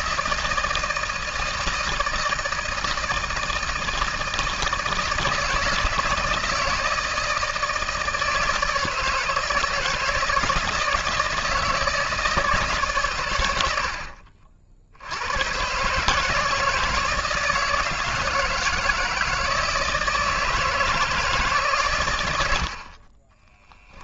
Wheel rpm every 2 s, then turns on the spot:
160, 160, 160, 160, 160, 160, 140, 60, 160, 160, 160, 60.
22-24